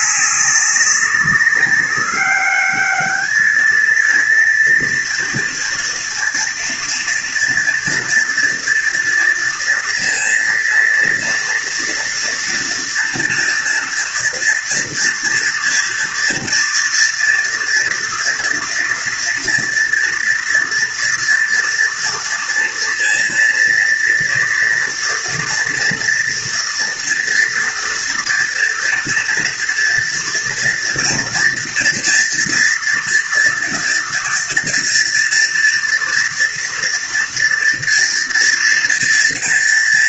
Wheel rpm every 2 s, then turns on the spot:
200, 210, 230, 240, 230, 230, 230, 230, 230, 240, 230, 230, 230, 230, 230, 230, 230, 230, 240, 230.
none